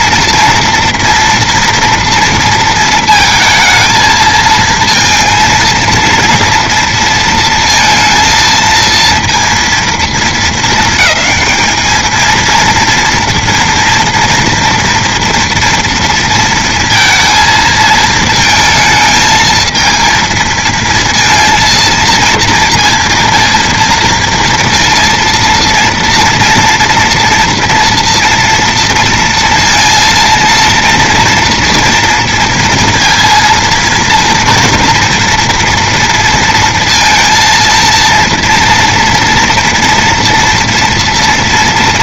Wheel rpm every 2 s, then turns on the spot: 230, 230, 220, 230, 230, 220, 230, 230, 230, 220, 230, 230, 230, 230, 230, 230, 230, 230, 230, 230, 230.
none